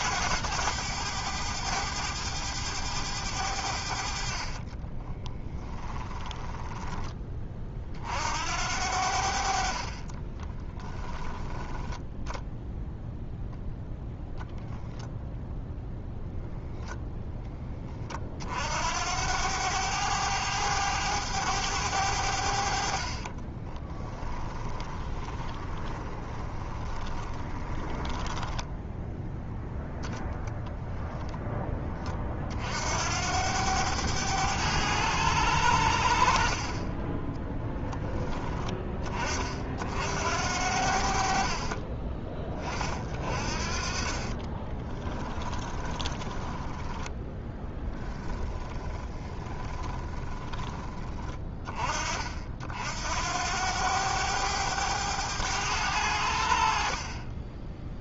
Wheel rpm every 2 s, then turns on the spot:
100, 100, 20, 10, 70, 10, 0, 0, 10, 70, 100, 50, 20, 20, 10, 0, 70, 100, 20, 20, 70, 40, 20, 10, 20, 20, 70, 100, 50.
4-6 10-12 22-28 36-38 44-50